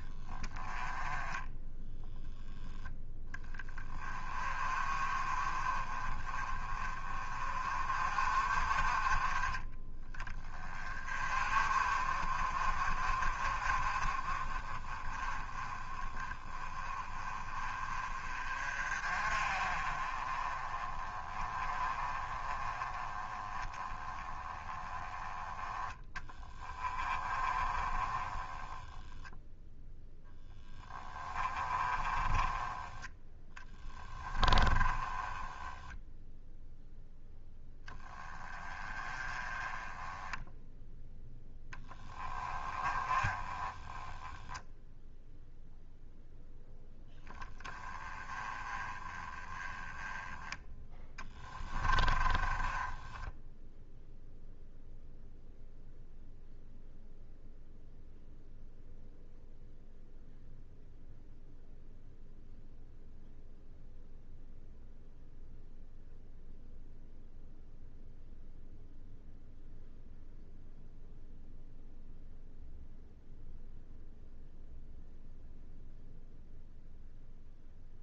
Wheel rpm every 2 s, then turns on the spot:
10, 10, 30, 30, 30, 30, 40, 20, 20, 40, 30, 20, 10, 20, 10, 10, 20, 20, 0, 20, 10, 20, 0, 10, 20, 10, 10, 0, 0, 0, 0, 0, 0, 0, 0, 0, 0, 0, 0.
26-32 34-36 42-44 52-54